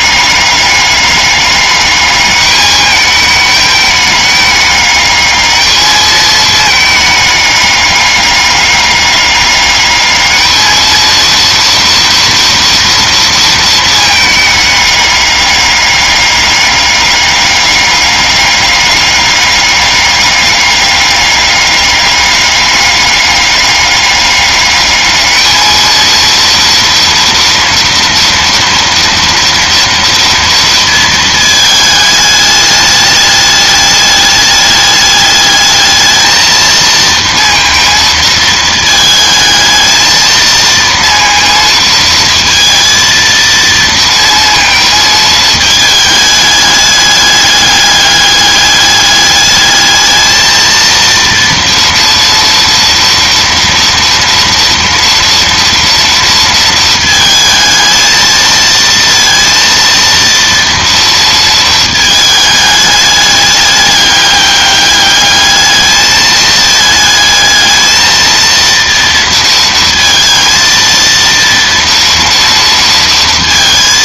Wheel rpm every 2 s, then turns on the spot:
200, 210, 210, 220, 200, 220, 230, 210, 200, 200, 200, 200, 210, 230, 230, 230, 210, 210, 220, 220, 230, 230, 220, 210, 200, 230, 230, 230, 220, 230, 230, 210, 200, 220, 230, 230, 230.
none